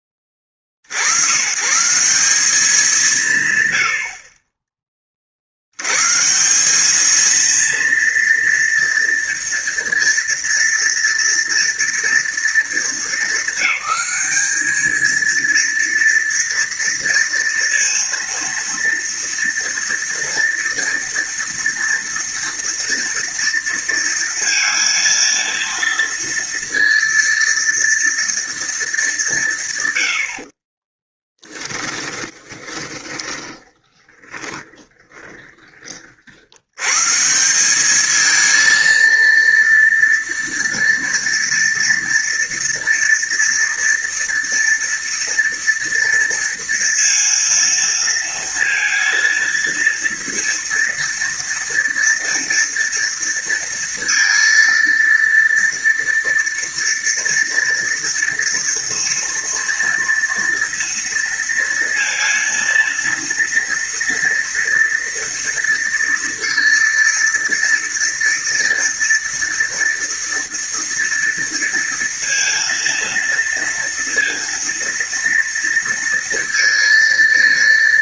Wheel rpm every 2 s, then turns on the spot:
50, 210, 40, 200, 230, 230, 230, 220, 230, 230, 230, 230, 230, 230, 210, 30, 20, 20, 140, 230, 230, 230, 230, 230, 230, 230, 230, 230, 230, 230, 230, 230, 230, 230, 230, 230, 230, 230, 230.
30-36